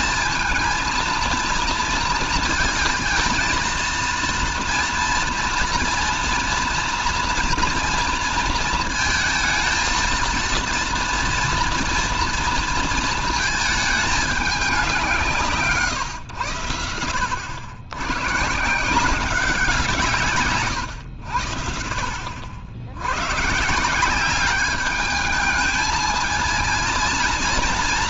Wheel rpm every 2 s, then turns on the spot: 230, 230, 240, 240, 230, 230, 230, 190, 100, 160, 130, 80, 200, 230.
none